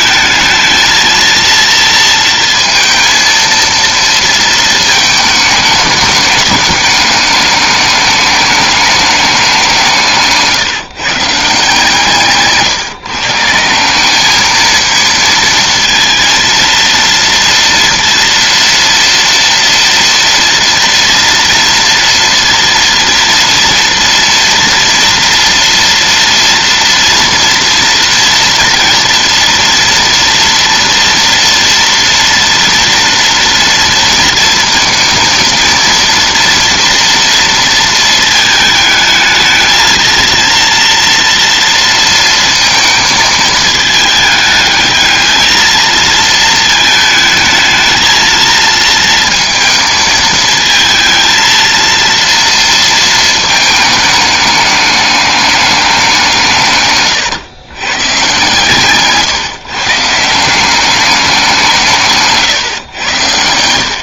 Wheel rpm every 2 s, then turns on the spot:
230, 230, 220, 210, 200, 150, 150, 230, 230, 230, 230, 230, 230, 230, 230, 230, 230, 230, 230, 220, 240, 220, 220, 220, 230, 220, 230, 210, 120, 150, 200, 120.
56-60